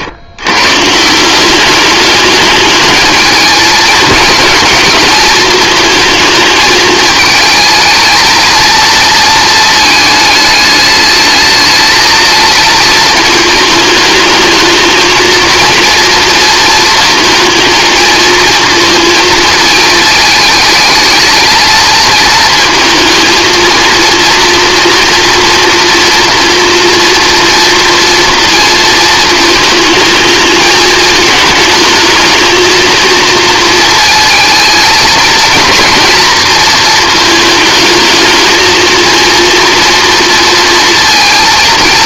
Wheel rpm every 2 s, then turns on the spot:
130, 210, 220, 220, 230, 210, 230, 220, 230, 230, 210, 220, 230, 230, 230, 220, 230, 220, 230, 220, 230.
none